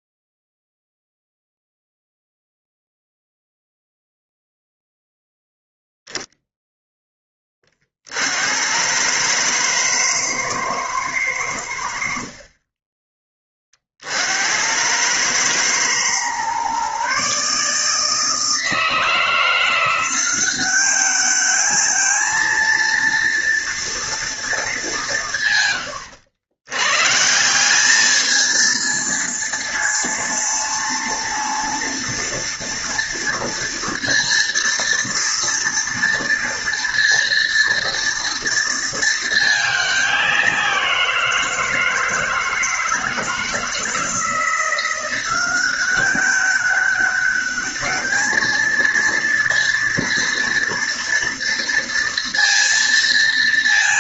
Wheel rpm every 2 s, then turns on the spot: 0, 0, 0, 10, 100, 110, 20, 90, 130, 160, 200, 230, 180, 120, 230, 230, 230, 230, 230, 230, 180, 160, 180, 200, 230, 230, 230.
none